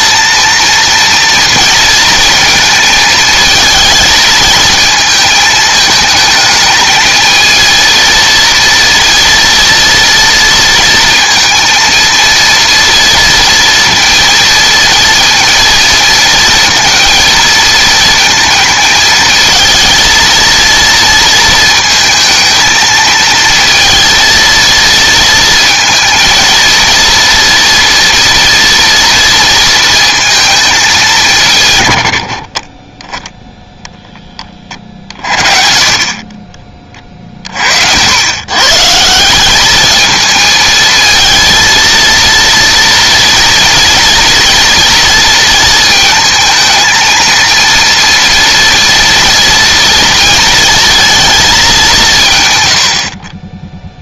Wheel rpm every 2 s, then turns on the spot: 230, 220, 220, 220, 230, 230, 230, 230, 230, 230, 230, 220, 230, 230, 230, 220, 40, 20, 40, 140, 220, 230, 230, 230, 230, 230, 110.
none